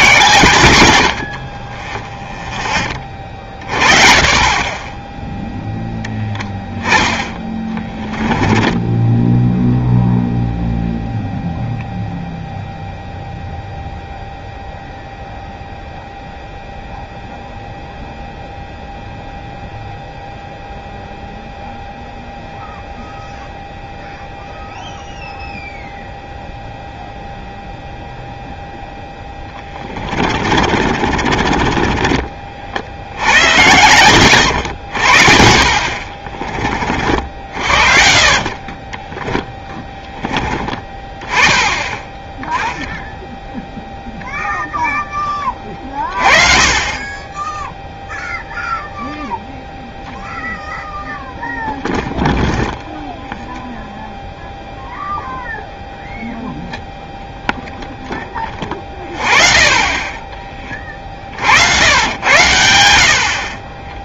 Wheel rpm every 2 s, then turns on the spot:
100, 10, 20, 0, 10, 0, 0, 0, 0, 0, 0, 0, 0, 0, 0, 40, 50, 90, 30, 30, 20, 10, 0, 30, 0, 0, 0, 0, 0, 30, 30, 80.
8-10 30-32 34-36